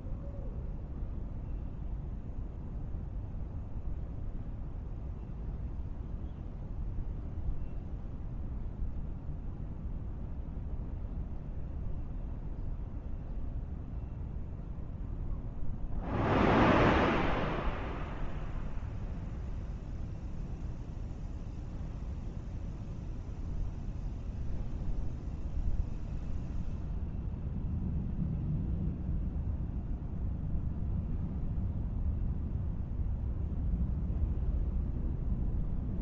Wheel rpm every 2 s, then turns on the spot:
0, 0, 0, 0, 0, 0, 0, 0, 0, 0, 0, 0, 0, 0, 0, 0, 0, 0.
none